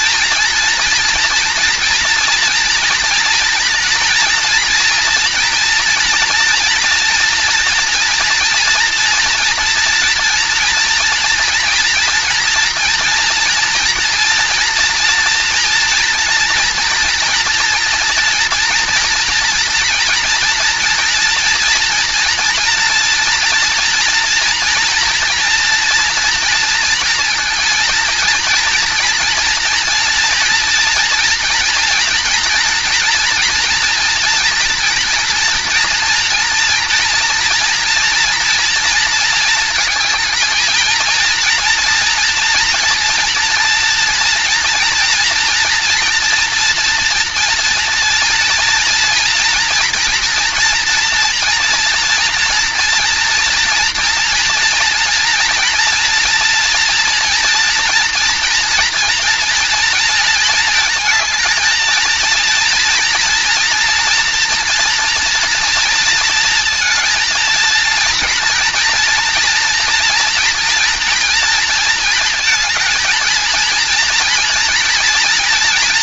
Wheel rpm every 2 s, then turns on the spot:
230, 230, 240, 230, 230, 230, 230, 240, 230, 230, 230, 230, 230, 230, 230, 240, 230, 230, 230, 230, 230, 230, 230, 230, 240, 230, 240, 240, 230, 230, 220, 240, 230, 230, 240, 240, 230, 230.
none